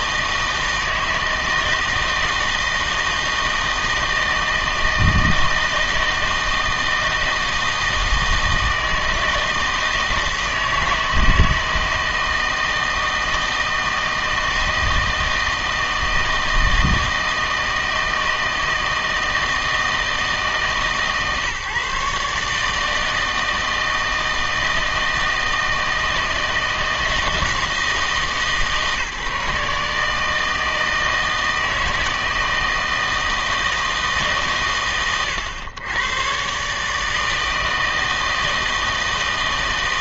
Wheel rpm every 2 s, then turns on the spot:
160, 160, 160, 160, 160, 160, 160, 160, 160, 160, 150, 150, 160, 160, 150, 160, 160, 130, 140, 160.
none